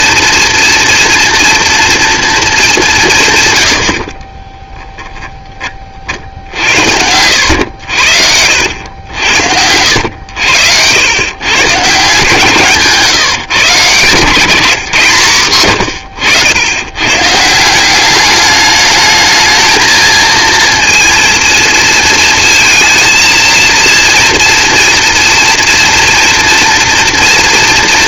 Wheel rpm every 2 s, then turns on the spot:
230, 200, 10, 70, 80, 90, 150, 150, 100, 210, 230, 230, 230, 230.
4-6 14-16